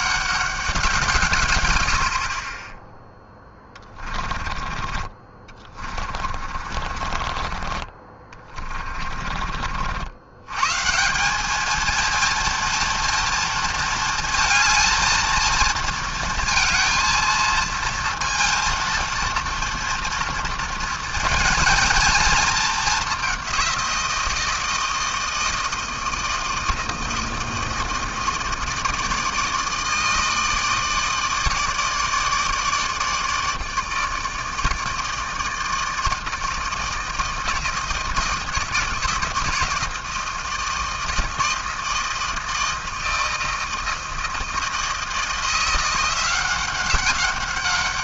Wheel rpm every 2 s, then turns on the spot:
190, 30, 30, 40, 30, 120, 230, 220, 220, 230, 230, 220, 160, 160, 160, 160, 150, 160, 160, 160, 160, 160, 160, 190.
4-10